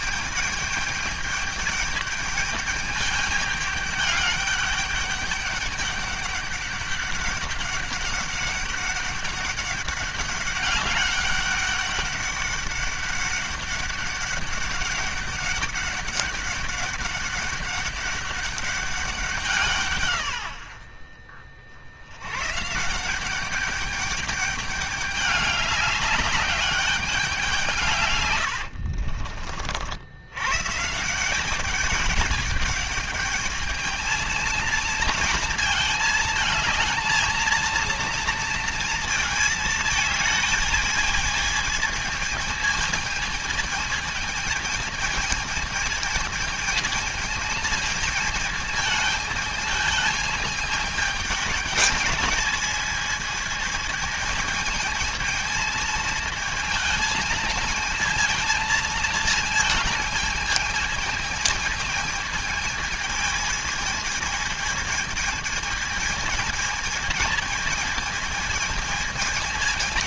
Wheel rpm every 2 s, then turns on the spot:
210, 210, 200, 200, 200, 200, 200, 200, 200, 200, 70, 140, 200, 200, 80, 140, 210, 220, 220, 230, 220, 220, 220, 220, 220, 220, 220, 220, 220, 220, 220, 220, 220, 220, 220.
28-30